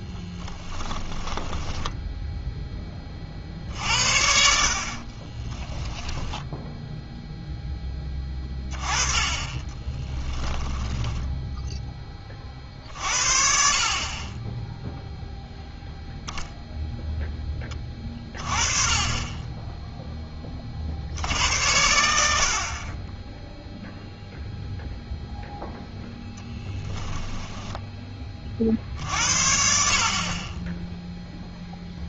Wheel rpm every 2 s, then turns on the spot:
10, 10, 60, 10, 20, 10, 40, 10, 0, 30, 50, 50, 0, 10, 50, 20.
0-2 6-8 10-12